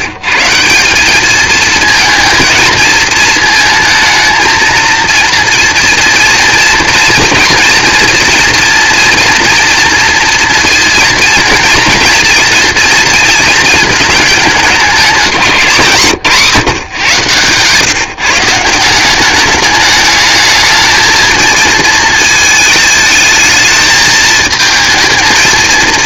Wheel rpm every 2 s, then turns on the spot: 180, 220, 230, 230, 230, 230, 230, 210, 140, 170, 220, 220, 220.
none